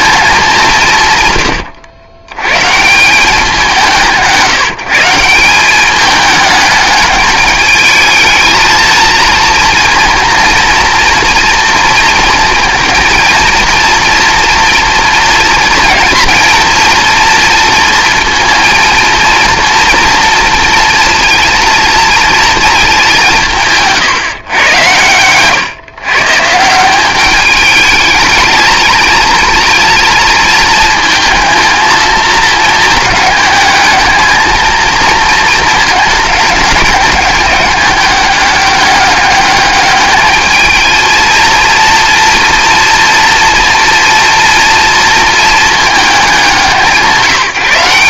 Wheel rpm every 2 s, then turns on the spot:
170, 150, 160, 210, 230, 230, 230, 240, 230, 230, 230, 220, 110, 170, 220, 230, 220, 220, 200, 200, 220, 230, 230, 180.
none